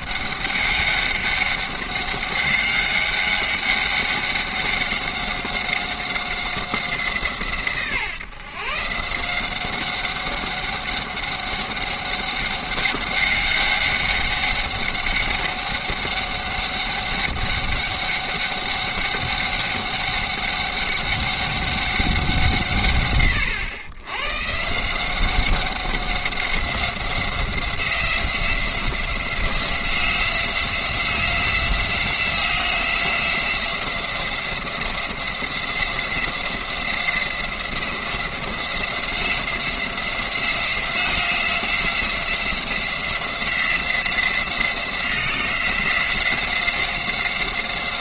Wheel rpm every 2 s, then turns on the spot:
200, 200, 190, 180, 160, 200, 200, 190, 200, 200, 200, 140, 160, 190, 180, 180, 180, 180, 180, 180, 180, 180, 180, 180.
none